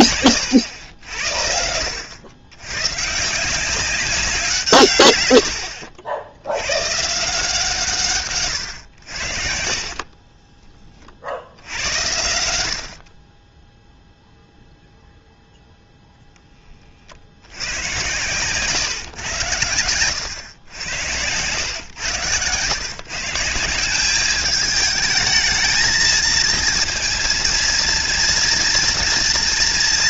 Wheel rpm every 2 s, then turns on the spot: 80, 130, 140, 130, 80, 30, 40, 0, 40, 140, 110, 130, 220, 230, 230.
none